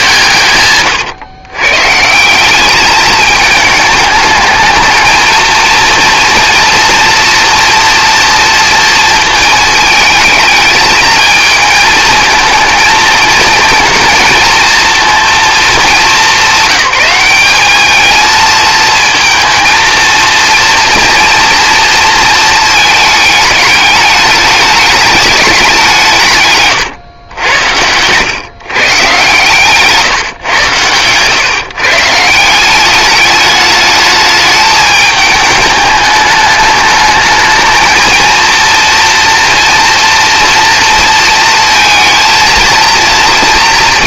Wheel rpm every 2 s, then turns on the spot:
120, 210, 220, 230, 230, 220, 230, 230, 200, 230, 230, 210, 210, 110, 130, 110, 210, 210, 220, 230, 230, 220.
none